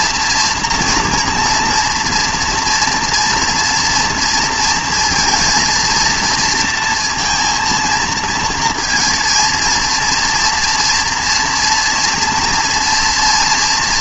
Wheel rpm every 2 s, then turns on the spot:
240, 240, 230, 230, 230, 230, 230.
none